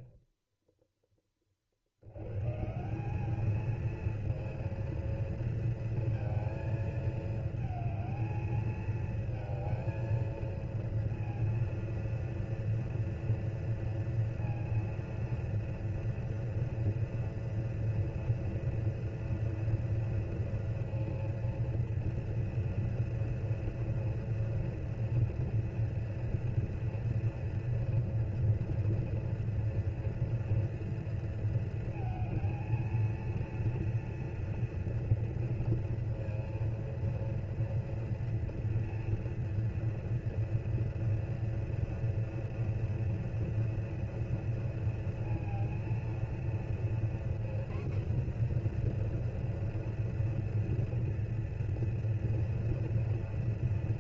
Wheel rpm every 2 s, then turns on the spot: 100, 230, 230, 220, 230, 230, 230, 230, 230, 230, 230, 230, 230, 230, 230, 230, 230, 230, 230, 230, 230, 240, 230, 240, 240, 230, 230.
none